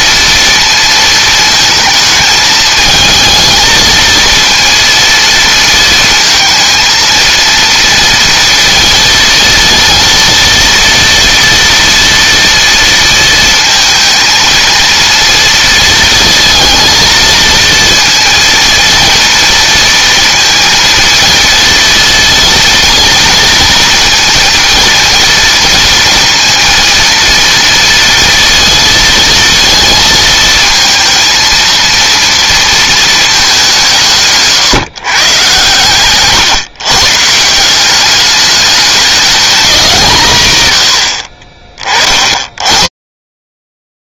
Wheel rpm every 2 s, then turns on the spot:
230, 220, 230, 220, 230, 230, 230, 230, 230, 230, 230, 230, 230, 230, 230, 230, 230, 150, 140, 200, 100, 30.
none